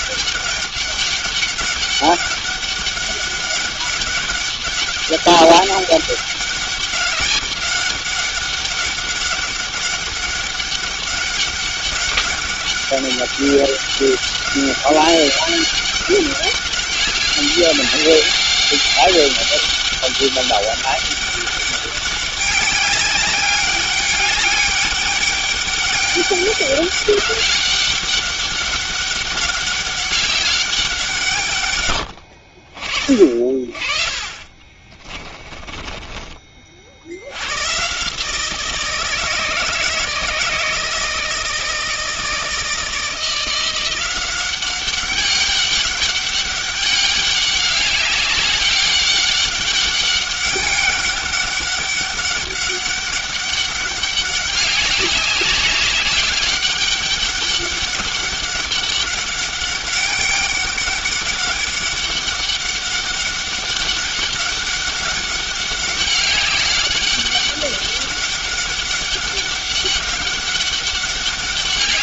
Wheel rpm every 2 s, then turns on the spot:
200, 200, 200, 200, 200, 200, 200, 200, 200, 200, 200, 200, 200, 200, 200, 180, 40, 30, 60, 160, 160, 160, 200, 200, 190, 200, 200, 190, 200, 200, 200, 200, 200, 200, 200, 200.
34-36